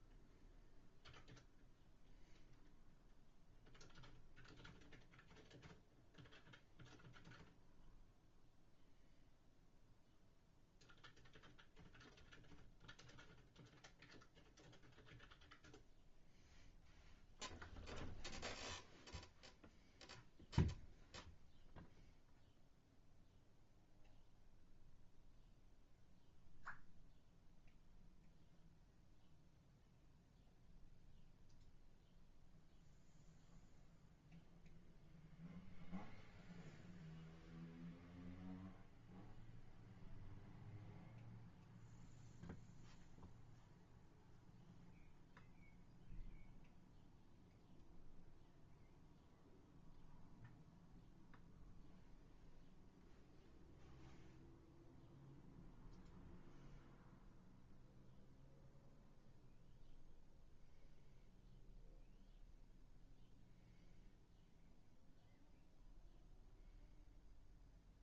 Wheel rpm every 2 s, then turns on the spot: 0, 0, 0, 0, 0, 0, 0, 0, 0, 0, 0, 0, 0, 0, 0, 0, 0, 0, 0, 0, 0, 0, 0, 0, 0, 0, 0, 0, 0, 0, 0, 0, 0, 0.
none